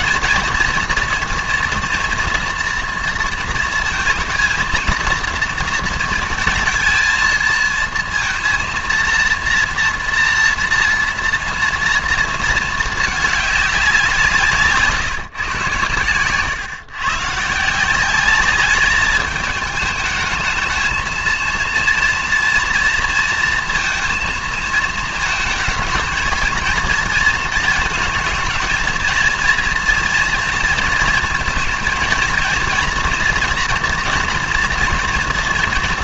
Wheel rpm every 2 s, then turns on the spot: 240, 230, 230, 230, 230, 230, 220, 150, 130, 200, 220, 230, 220, 220, 230, 230, 230, 230.
14-16